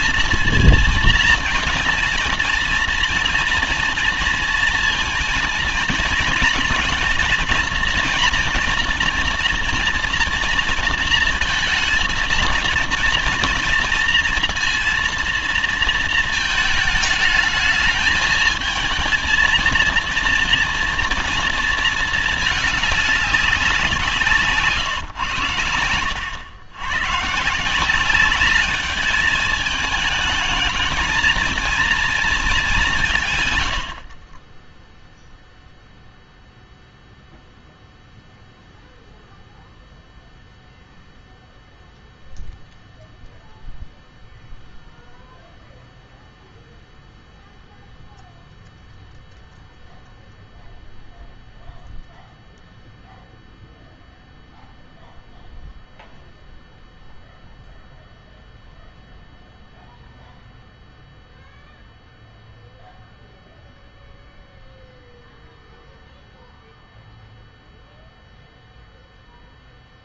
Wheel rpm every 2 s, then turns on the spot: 230, 230, 230, 230, 230, 230, 230, 230, 220, 220, 230, 220, 150, 90, 200, 220, 220, 30, 0, 0, 0, 0, 0, 0, 0, 0, 0, 0, 0, 0, 0, 0, 0, 0, 0.
none